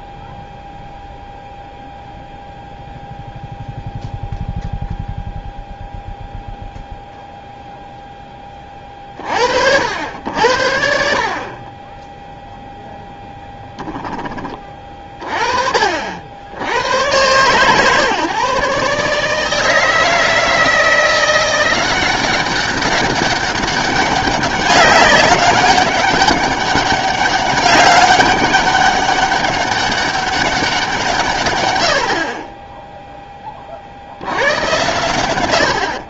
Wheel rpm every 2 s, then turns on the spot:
0, 0, 0, 0, 30, 70, 0, 30, 90, 140, 170, 200, 190, 200, 200, 180, 20, 100.
none